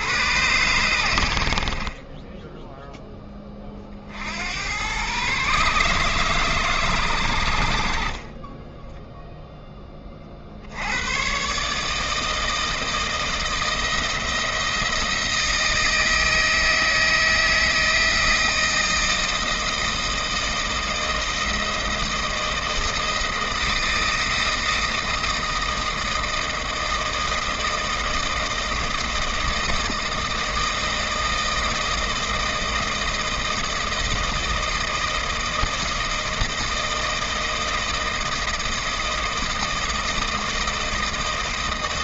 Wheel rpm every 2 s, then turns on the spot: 100, 0, 100, 110, 10, 80, 160, 170, 160, 160, 160, 160, 160, 160, 160, 160, 160, 160, 160, 160, 160.
none